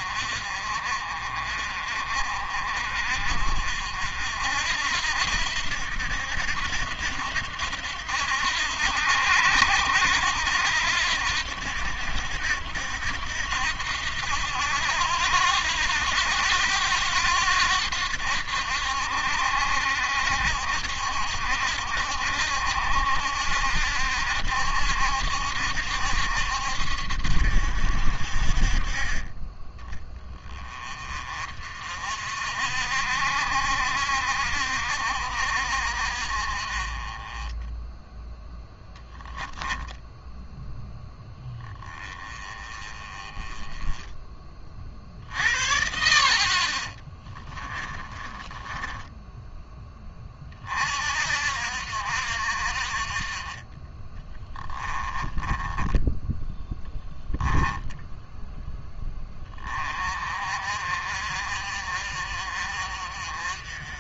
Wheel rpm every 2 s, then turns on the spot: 50, 50, 70, 80, 80, 80, 80, 80, 90, 70, 70, 70, 70, 70, 40, 30, 60, 60, 30, 0, 10, 20, 50, 40, 10, 50, 50, 20, 20, 10, 50, 50.
46-50 54-58